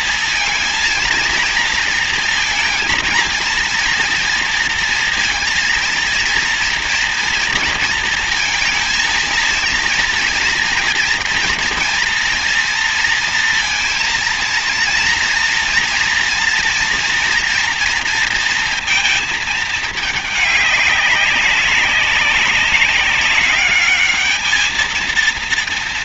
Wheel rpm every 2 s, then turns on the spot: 230, 230, 230, 230, 230, 230, 230, 230, 230, 230, 200, 190, 210.
none